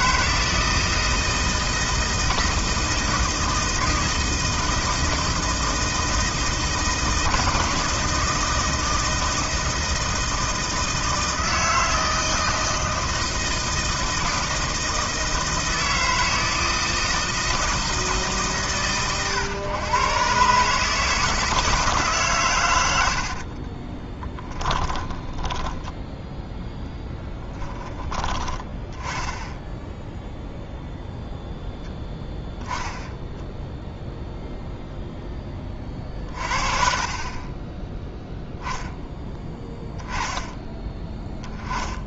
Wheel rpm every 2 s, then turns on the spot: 160, 160, 160, 160, 170, 160, 160, 160, 160, 130, 150, 100, 20, 0, 10, 0, 0, 0, 40, 0, 20.
24-26